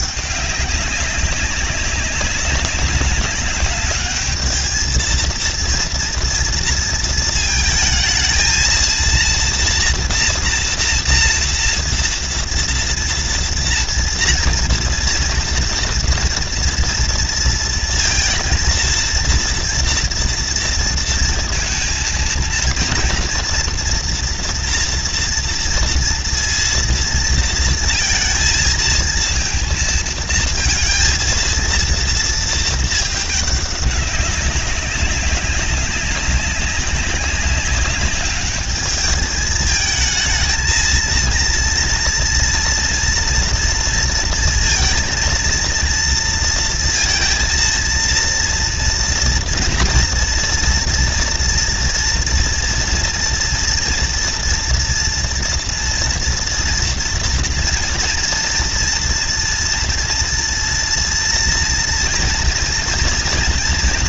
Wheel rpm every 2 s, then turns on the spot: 210, 200, 210, 230, 230, 230, 230, 240, 230, 230, 230, 230, 230, 230, 230, 230, 230, 200, 190, 200, 220, 240, 230, 230, 230, 230, 230, 240, 230, 230, 230, 230.
none